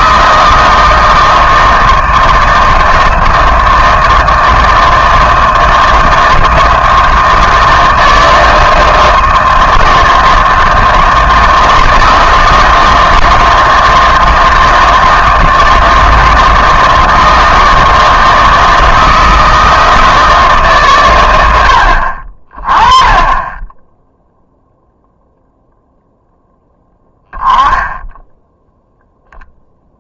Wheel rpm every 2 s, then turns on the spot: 160, 160, 160, 160, 160, 160, 160, 160, 160, 160, 150, 30, 0, 0, 0.
none